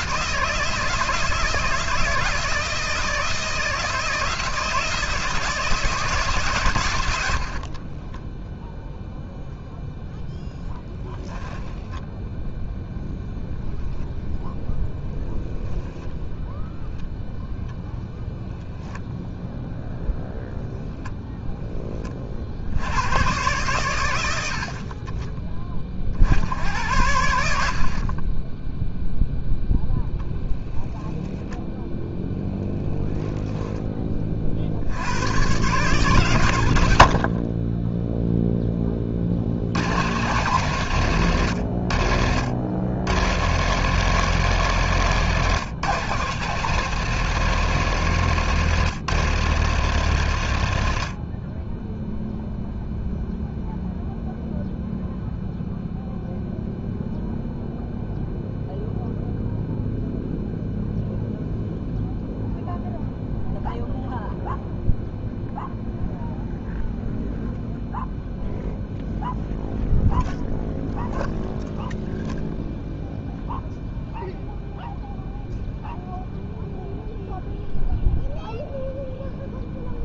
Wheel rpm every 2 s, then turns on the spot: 160, 160, 160, 130, 0, 10, 0, 0, 0, 0, 0, 70, 70, 80, 0, 0, 0, 40, 110, 10, 140, 90, 160, 150, 160, 110, 0, 0, 0, 0, 0, 0, 0, 0, 0, 0, 0, 0, 0, 0.
none